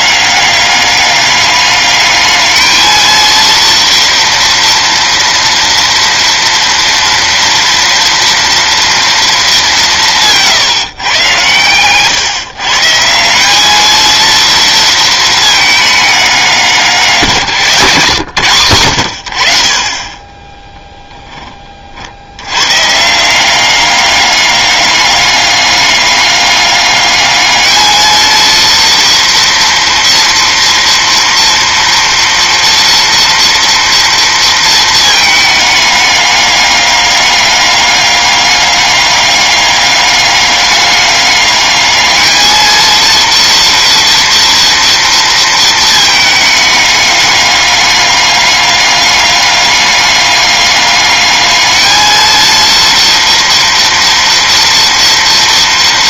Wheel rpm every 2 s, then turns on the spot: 200, 220, 240, 230, 230, 160, 150, 230, 180, 100, 10, 120, 200, 200, 230, 230, 230, 230, 200, 200, 200, 220, 240, 210, 200, 200, 230, 230.
20-22